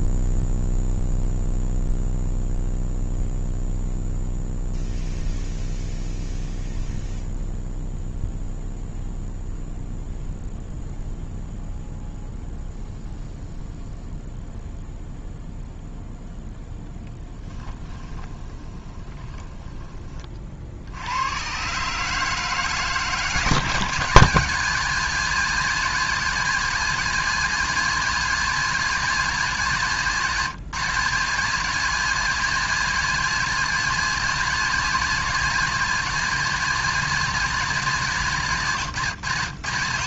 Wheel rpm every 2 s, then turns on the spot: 0, 0, 0, 0, 0, 0, 0, 0, 0, 20, 70, 160, 180, 180, 180, 150, 180, 180, 180, 150.
18-20